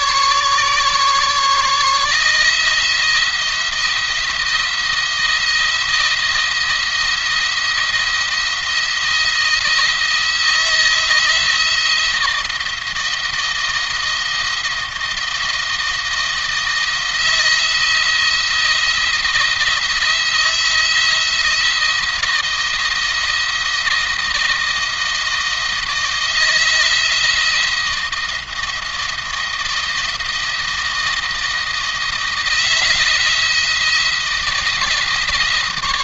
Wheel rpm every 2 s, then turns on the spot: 140, 160, 170, 170, 170, 170, 170, 160, 170, 170, 170, 170, 170, 160, 170, 170, 170, 170.
none